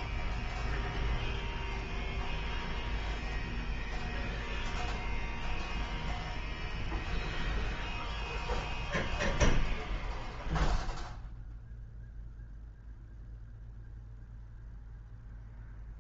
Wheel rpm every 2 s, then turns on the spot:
0, 0, 0, 0, 0, 0, 0, 0.
none